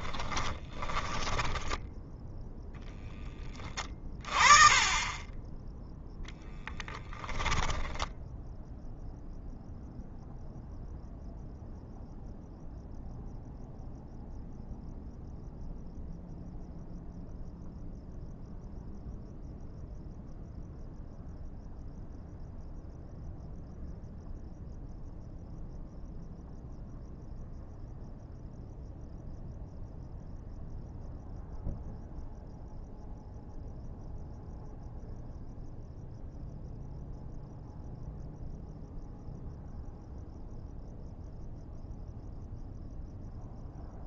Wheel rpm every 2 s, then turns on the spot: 20, 10, 30, 10, 0, 0, 0, 0, 0, 0, 0, 0, 0, 0, 0, 0, 0, 0, 0, 0, 0, 0.
0-2 6-8